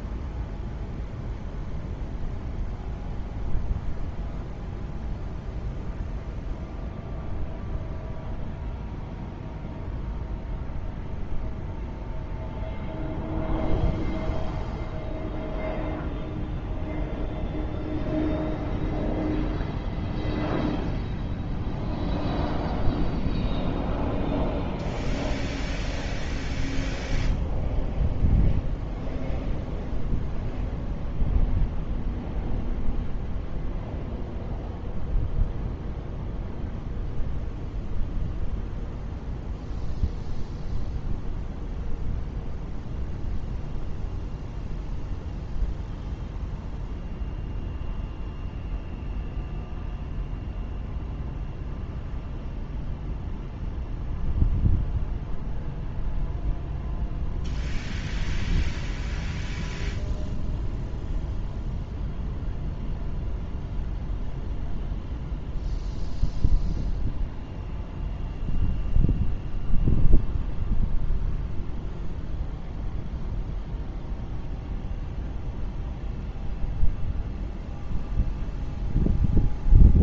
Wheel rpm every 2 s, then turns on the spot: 0, 0, 0, 0, 0, 0, 0, 0, 0, 0, 0, 0, 0, 0, 0, 0, 0, 0, 0, 0, 0, 0, 0, 0, 0, 0, 0, 0, 0, 0, 0, 0, 0, 0, 0, 0, 0, 0, 0, 0.
none